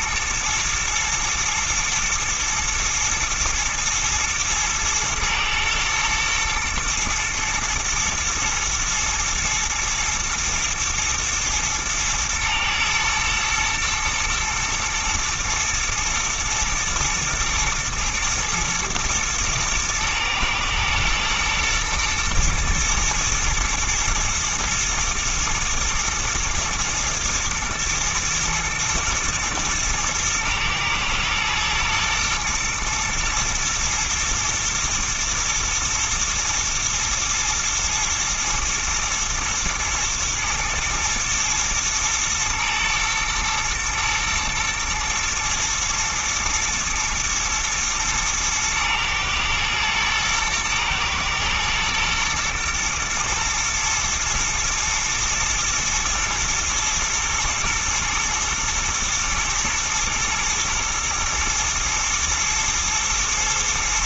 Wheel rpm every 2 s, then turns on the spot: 120, 120, 110, 120, 120, 110, 110, 110, 120, 120, 110, 110, 110, 110, 110, 120, 120, 110, 110, 120, 110, 110, 110, 120, 110, 110, 110, 110, 120, 120, 110, 110.
none